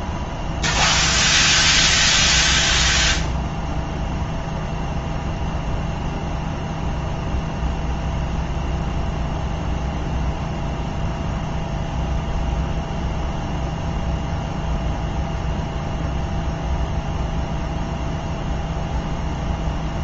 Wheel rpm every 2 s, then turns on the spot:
0, 0, 0, 0, 0, 0, 0, 0, 0, 0.
none